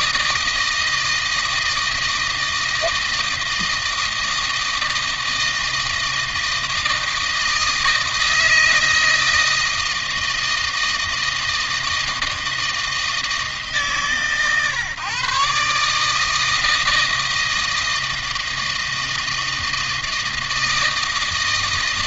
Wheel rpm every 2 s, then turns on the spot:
160, 160, 160, 160, 160, 160, 160, 140, 160, 160, 160.
none